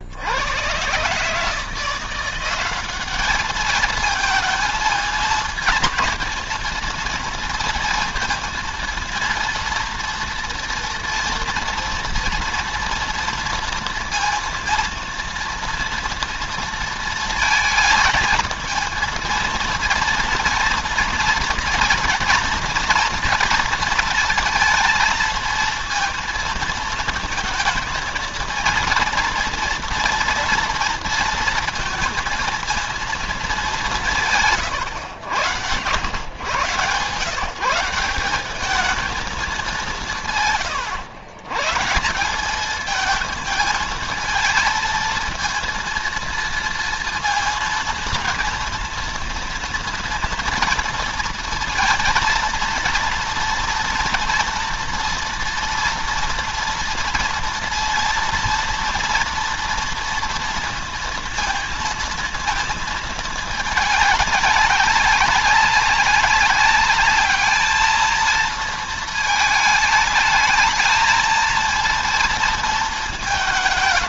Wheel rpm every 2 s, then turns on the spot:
110, 200, 230, 220, 230, 240, 230, 230, 230, 220, 230, 240, 230, 230, 230, 230, 230, 110, 120, 210, 120, 210, 230, 230, 230, 230, 230, 230, 230, 230, 230, 230, 200, 200, 220, 220, 220.
40-42